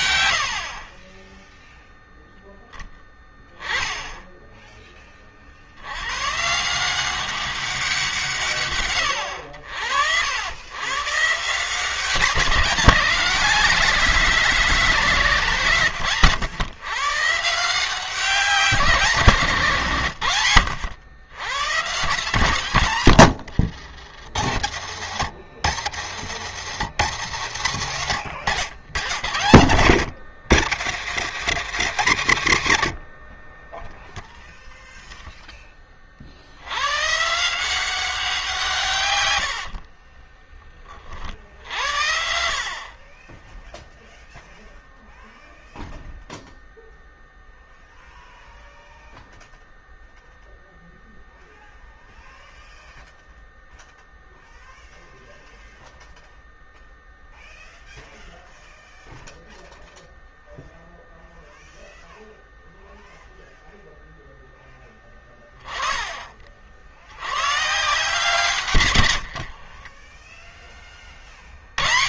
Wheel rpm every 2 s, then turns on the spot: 30, 10, 30, 180, 110, 120, 180, 170, 140, 170, 90, 120, 70, 90, 80, 100, 50, 0, 110, 130, 30, 30, 0, 0, 0, 0, 0, 0, 0, 0, 0, 0, 10, 70, 100, 30.
68-70